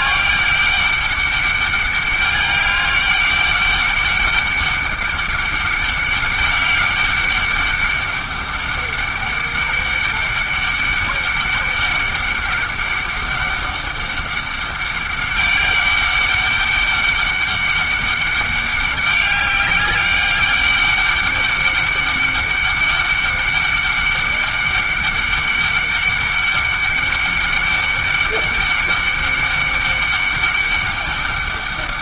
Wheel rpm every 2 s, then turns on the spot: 200, 200, 200, 190, 200, 200, 200, 200, 200, 200, 200, 200, 200, 200, 200, 200.
none